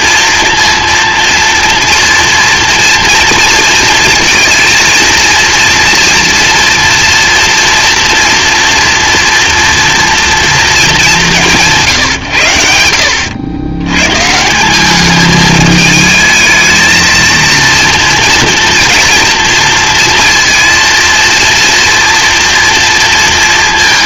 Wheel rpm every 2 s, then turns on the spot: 230, 230, 230, 230, 230, 210, 90, 210, 220, 230, 230, 230.
none